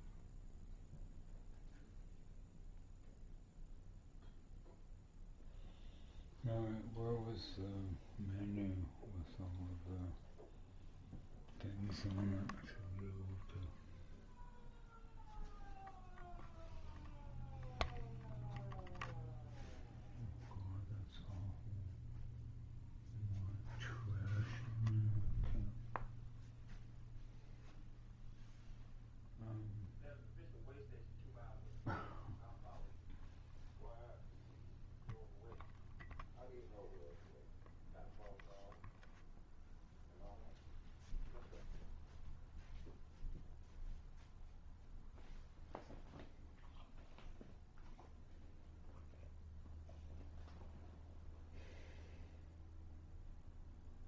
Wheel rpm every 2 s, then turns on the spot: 0, 0, 0, 0, 0, 0, 0, 0, 0, 0, 0, 0, 0, 0, 0, 0, 0, 0, 0, 0, 0, 0, 0, 0, 0, 0, 0.
none